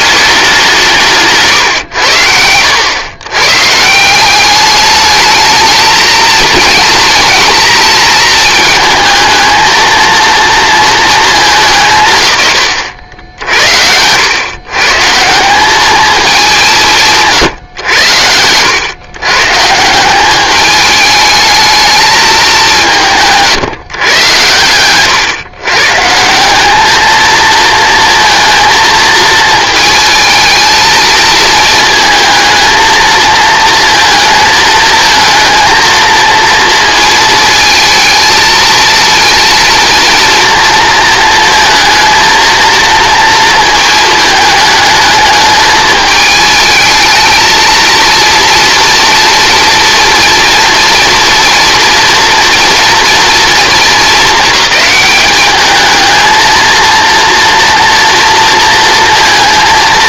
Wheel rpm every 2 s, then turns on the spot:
180, 90, 200, 230, 220, 230, 120, 130, 190, 100, 210, 200, 110, 190, 220, 220, 230, 220, 230, 220, 230, 230, 220, 210, 230, 230, 240, 200, 230, 230.
24-26